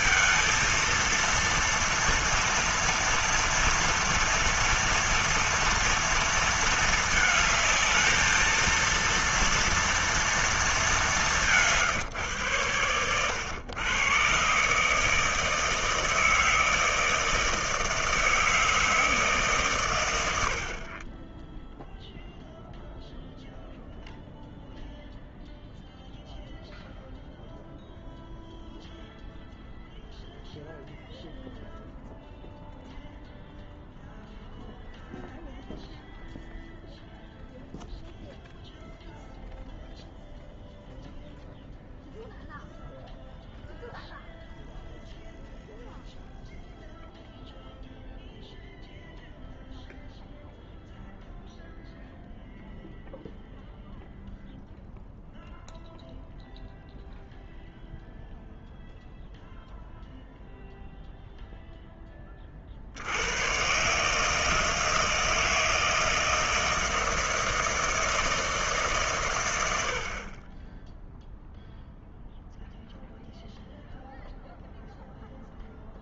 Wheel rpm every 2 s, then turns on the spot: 230, 230, 230, 220, 230, 210, 110, 150, 160, 160, 30, 0, 0, 0, 0, 0, 0, 0, 0, 0, 0, 0, 0, 0, 0, 0, 0, 0, 0, 0, 0, 70, 160, 160, 140, 10, 0, 0.
none